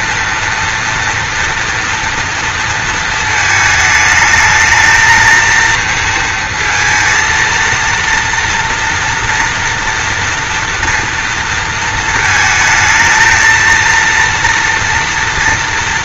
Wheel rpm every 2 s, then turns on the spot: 240, 230, 220, 230, 230, 230, 220, 230.
none